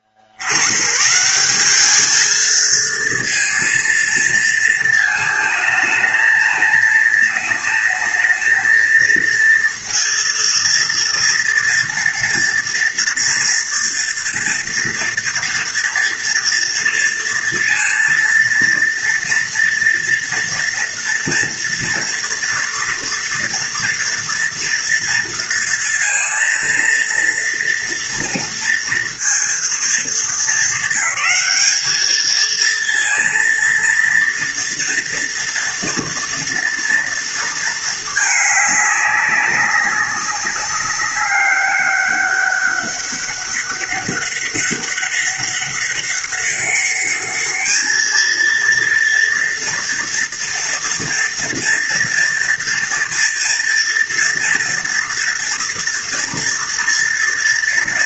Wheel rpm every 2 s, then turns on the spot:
50, 220, 230, 220, 230, 230, 230, 230, 230, 230, 230, 230, 240, 230, 230, 220, 220, 230, 230, 210, 200, 200, 200, 200, 220, 230, 230, 230, 230.
none